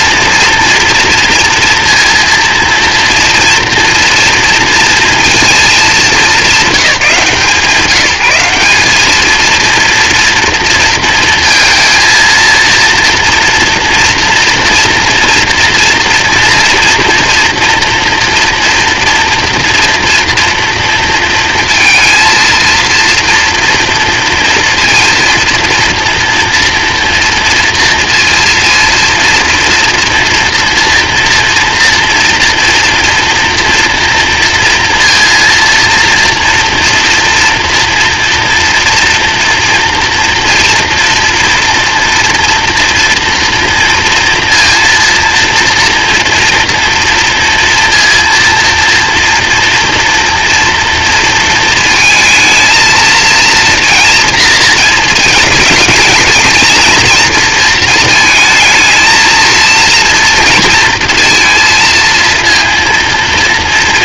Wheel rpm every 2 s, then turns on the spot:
230, 230, 230, 170, 200, 230, 230, 230, 230, 240, 230, 230, 230, 230, 230, 230, 230, 230, 240, 230, 240, 240, 240, 230, 230, 230, 230, 220, 230, 220, 230, 230.
none